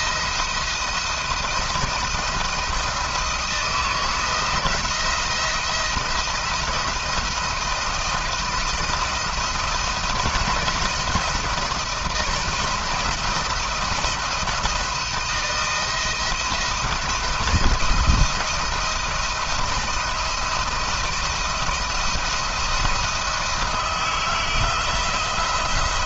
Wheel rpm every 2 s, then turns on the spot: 170, 170, 170, 170, 170, 170, 160, 160, 160, 160, 170, 170, 160.
none